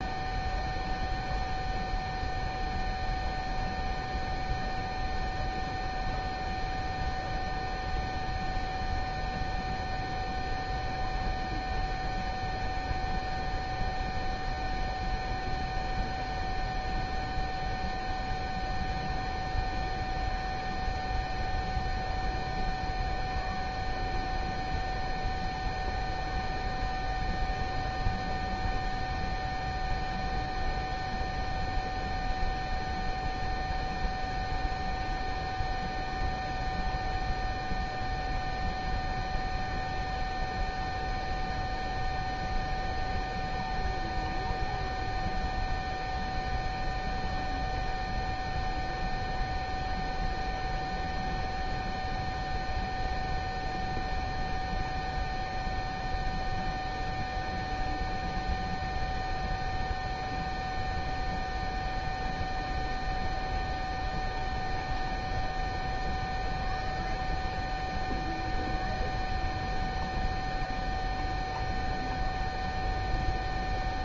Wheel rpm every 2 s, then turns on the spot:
0, 0, 0, 0, 0, 0, 0, 0, 0, 0, 0, 0, 0, 0, 0, 0, 0, 0, 0, 0, 0, 0, 0, 0, 0, 0, 0, 0, 0, 0, 0, 0, 0, 0, 0, 0, 0.
none